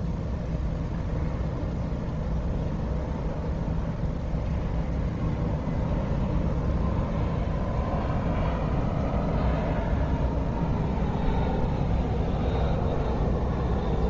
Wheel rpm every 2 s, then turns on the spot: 0, 0, 0, 0, 0, 0, 0.
none